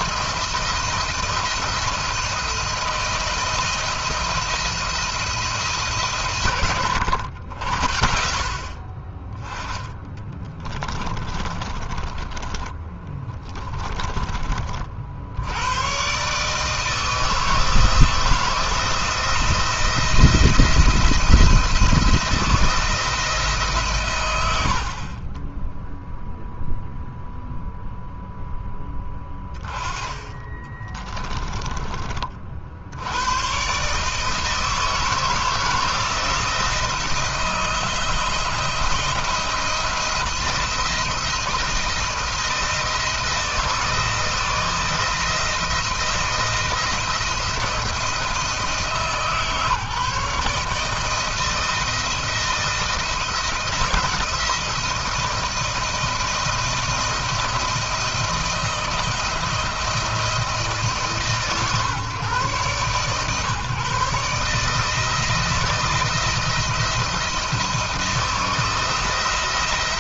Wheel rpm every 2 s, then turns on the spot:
170, 170, 170, 120, 40, 30, 20, 40, 150, 160, 170, 170, 80, 0, 10, 20, 60, 160, 170, 170, 170, 160, 160, 170, 160, 160, 170, 170, 170, 170, 160, 140, 160, 170, 170.
10-14 30-32